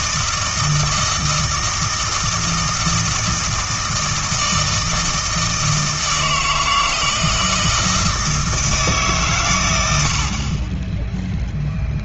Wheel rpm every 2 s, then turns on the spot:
160, 160, 160, 160, 160, 30.
none